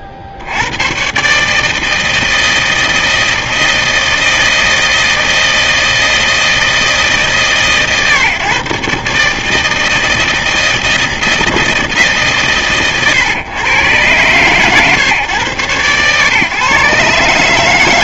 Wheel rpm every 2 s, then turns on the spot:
60, 160, 160, 160, 130, 160, 120, 120, 120.
none